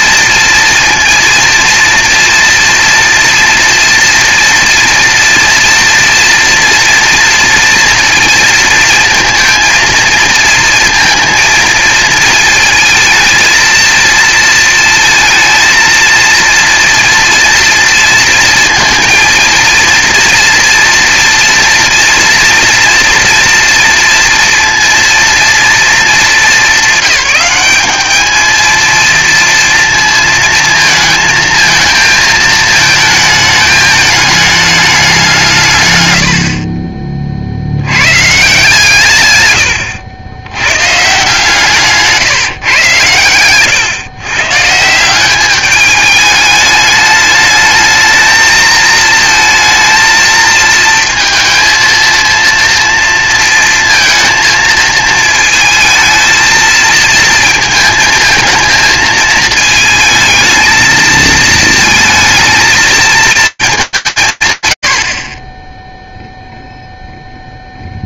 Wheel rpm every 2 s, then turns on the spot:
230, 230, 230, 230, 230, 220, 220, 230, 230, 230, 230, 230, 230, 210, 230, 230, 220, 130, 60, 110, 160, 120, 210, 220, 230, 230, 230, 230, 230, 220, 230, 220, 20, 0.
none